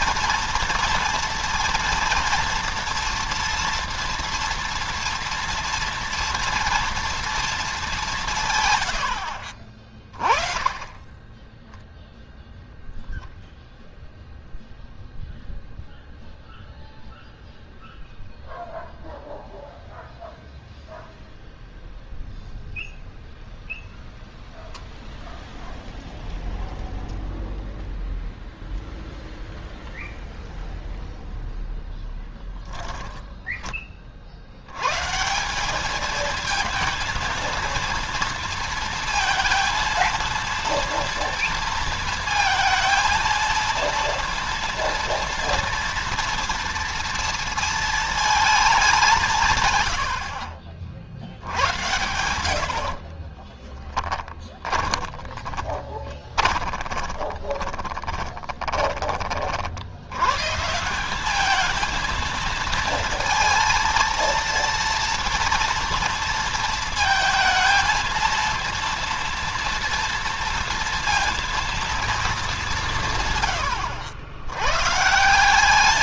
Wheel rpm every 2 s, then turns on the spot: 230, 240, 230, 230, 140, 20, 0, 0, 0, 0, 0, 0, 0, 0, 0, 0, 10, 70, 220, 230, 230, 230, 230, 230, 210, 50, 80, 20, 20, 20, 120, 220, 230, 230, 230, 230, 200, 100.
32-34 52-60